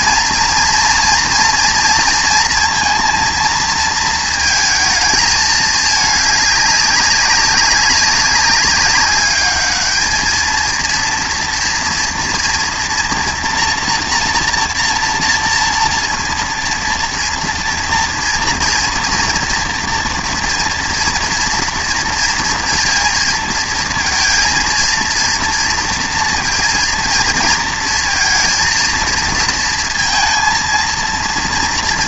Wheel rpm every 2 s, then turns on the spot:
230, 230, 220, 200, 200, 230, 230, 230, 230, 230, 240, 230, 230, 230, 230, 230.
none